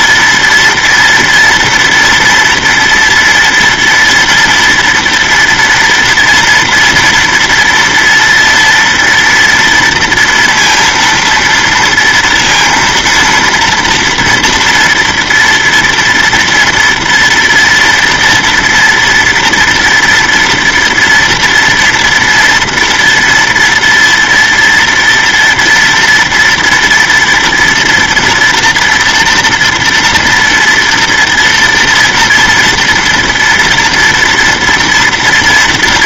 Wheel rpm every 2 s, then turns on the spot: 230, 240, 230, 230, 230, 230, 230, 230, 230, 230, 230, 230, 230, 230, 230, 230, 230, 230.
none